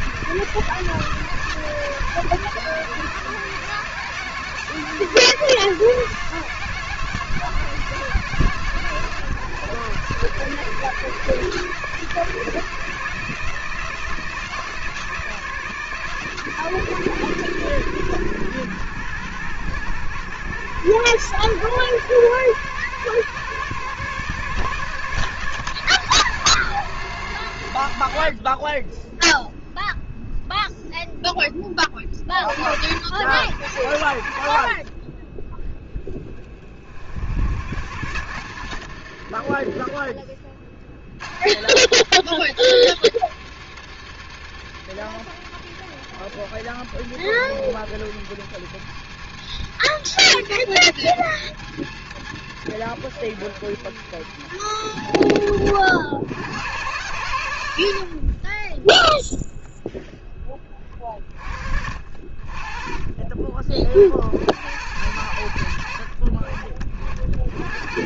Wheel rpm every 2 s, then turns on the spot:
160, 160, 170, 160, 150, 160, 160, 170, 160, 120, 130, 140, 130, 130, 20, 10, 70, 40, 50, 100, 60, 100, 100, 110, 110, 110, 110, 90, 110, 10, 30, 30, 100, 50.
none